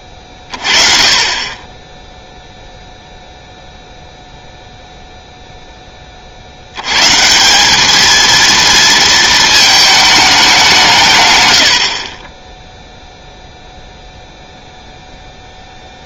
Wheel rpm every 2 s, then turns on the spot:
30, 0, 0, 80, 230, 200, 10, 0.
none